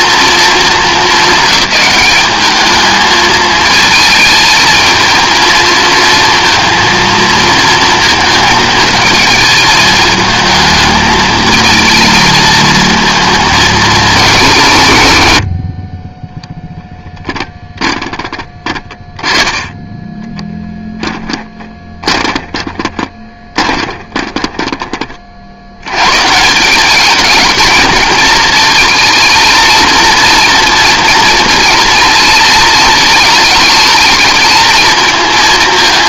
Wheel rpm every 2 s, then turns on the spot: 210, 210, 220, 230, 220, 220, 220, 150, 0, 10, 10, 20, 30, 200, 220, 230, 220, 220.
20-26